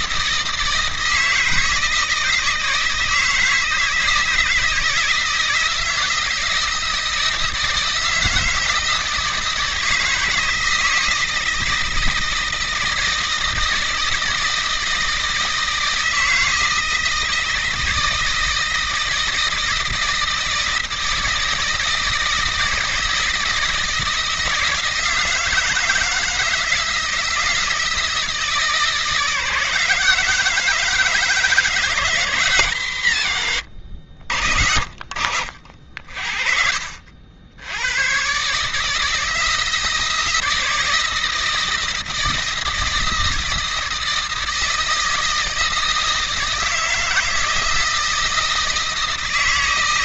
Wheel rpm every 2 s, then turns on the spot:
160, 160, 160, 160, 160, 160, 160, 160, 160, 160, 160, 160, 160, 160, 160, 160, 130, 60, 70, 150, 160, 160, 160, 170, 160.
none